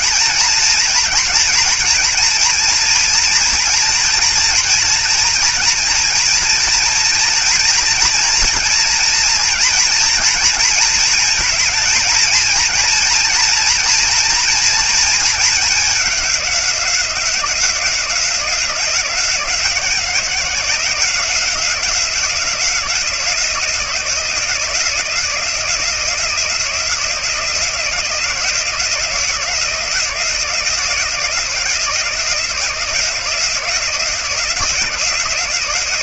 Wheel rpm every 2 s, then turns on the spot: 230, 230, 240, 230, 230, 230, 230, 230, 190, 180, 180, 170, 170, 170, 170, 170, 170, 170.
none